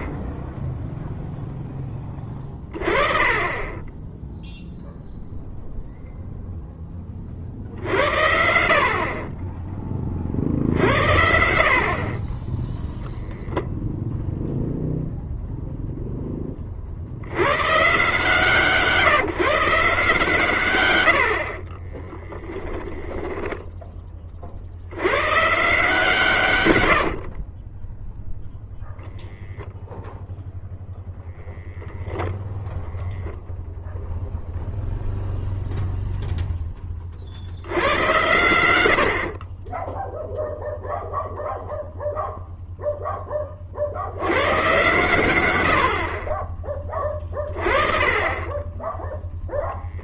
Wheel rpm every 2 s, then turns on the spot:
20, 0, 10, 60, 60, 10, 0, 40, 160, 120, 10, 60, 100, 10, 0, 0, 0, 10, 90, 0, 0, 110, 30, 20, 0.
20-22